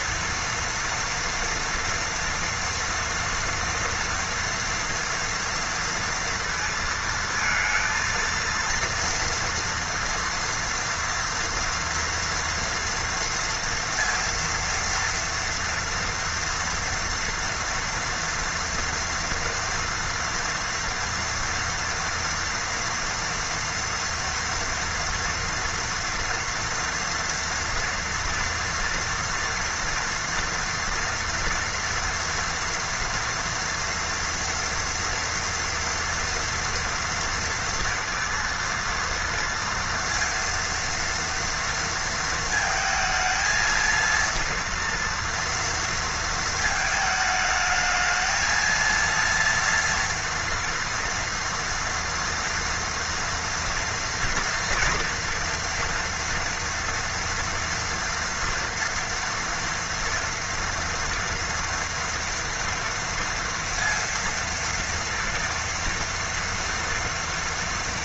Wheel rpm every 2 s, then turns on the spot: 230, 230, 230, 230, 230, 230, 230, 230, 230, 230, 230, 230, 230, 230, 240, 240, 230, 230, 240, 230, 230, 220, 230, 220, 230, 230, 230, 230, 230, 230, 230, 230, 230, 230.
none